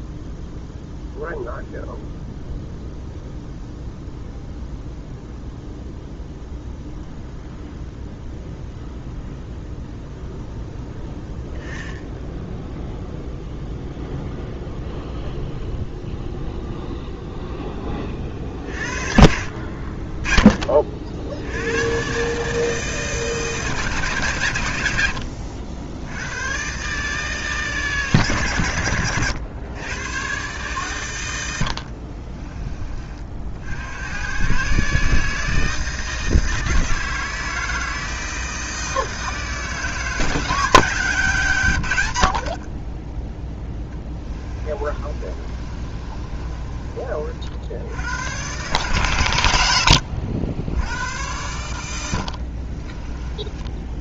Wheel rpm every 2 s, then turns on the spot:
0, 0, 0, 0, 0, 0, 0, 0, 0, 40, 40, 160, 110, 140, 100, 120, 30, 150, 160, 160, 170, 40, 30, 30, 120, 90, 40.
44-46 52-54